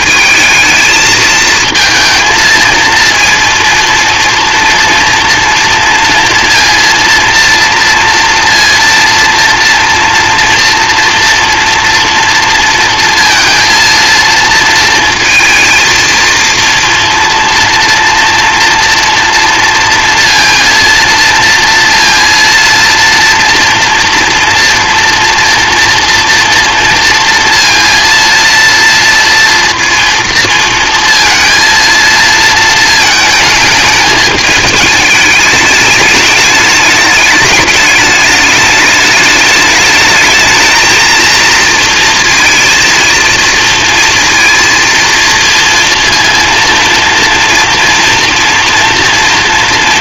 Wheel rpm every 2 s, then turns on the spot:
220, 230, 240, 230, 230, 230, 230, 230, 240, 230, 230, 230, 230, 230, 230, 230, 230, 210, 210, 210, 220, 230, 230, 230, 230.
none